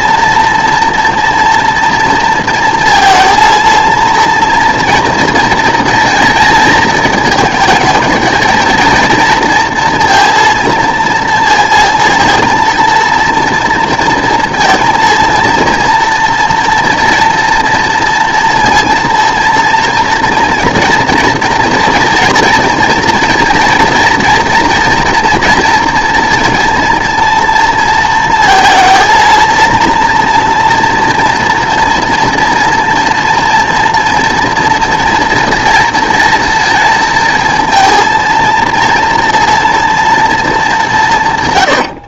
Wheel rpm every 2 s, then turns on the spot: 230, 230, 230, 220, 230, 230, 230, 230, 230, 230, 230, 230, 230, 230, 230, 240, 230, 230, 230, 230, 210.
none